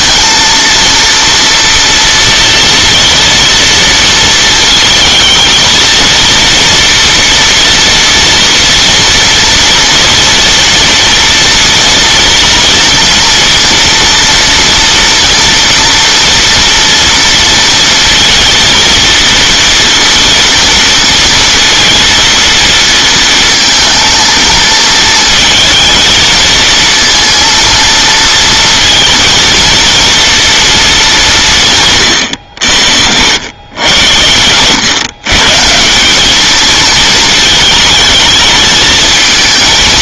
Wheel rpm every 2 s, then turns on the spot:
230, 240, 220, 230, 240, 230, 230, 230, 230, 230, 230, 230, 220, 230, 230, 220, 80, 110, 220, 220.
none